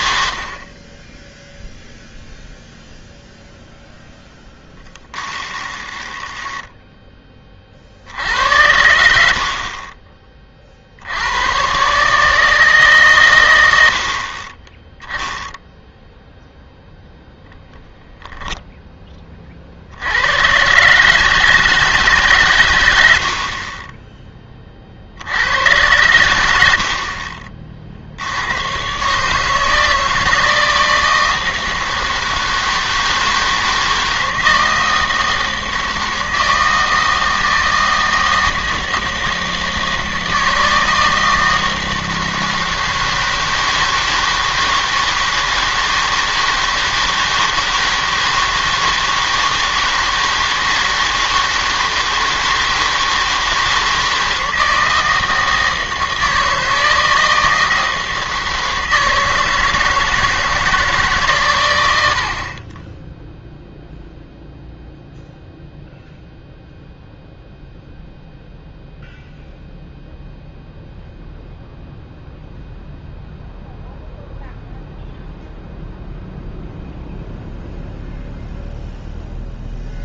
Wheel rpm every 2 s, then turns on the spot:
50, 0, 10, 10, 90, 40, 150, 20, 0, 0, 120, 120, 30, 80, 100, 170, 160, 160, 160, 160, 160, 160, 160, 160, 160, 160, 160, 160, 160, 160, 160, 40, 0, 0, 0, 0, 0, 0, 0, 0.
4-8